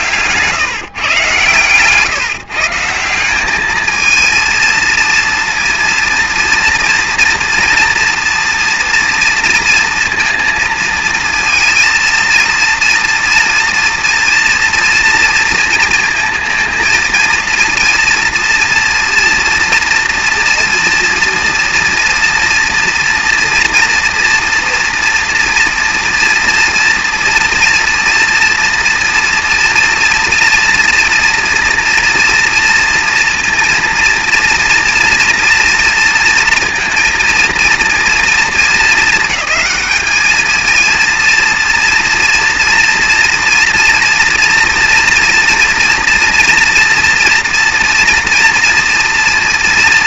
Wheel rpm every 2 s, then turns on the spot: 140, 150, 230, 230, 240, 230, 230, 240, 230, 230, 230, 230, 240, 230, 230, 230, 230, 230, 230, 230, 220, 230, 230, 230, 230.
none